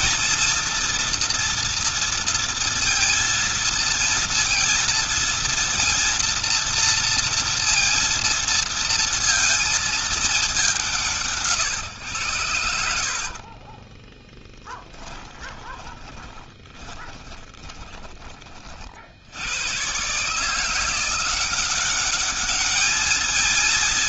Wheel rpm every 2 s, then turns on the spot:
230, 230, 230, 230, 230, 180, 60, 10, 20, 60, 170, 210.
12-18